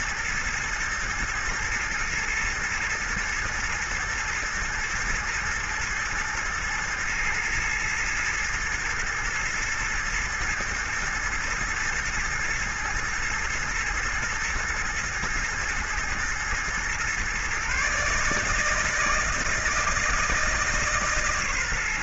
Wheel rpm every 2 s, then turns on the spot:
120, 120, 120, 120, 110, 120, 110, 120, 120, 160, 150.
none